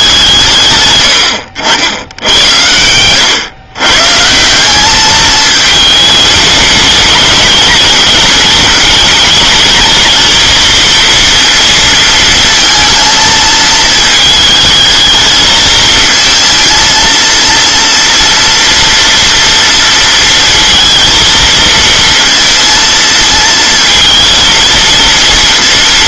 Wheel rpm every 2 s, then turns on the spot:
130, 100, 180, 210, 210, 230, 230, 220, 230, 240, 230, 230, 230.
2-4